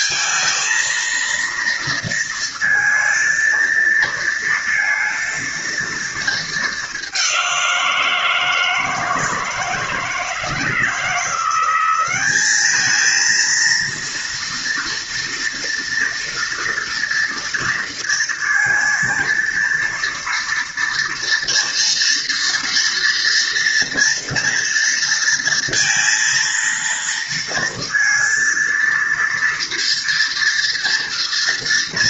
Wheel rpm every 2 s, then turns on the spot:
230, 230, 230, 210, 160, 170, 210, 240, 240, 220, 230, 230, 230, 230, 230, 230.
none